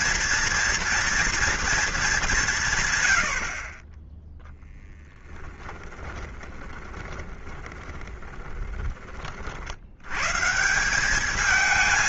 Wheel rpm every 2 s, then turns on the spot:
240, 170, 0, 20, 20, 150.
6-10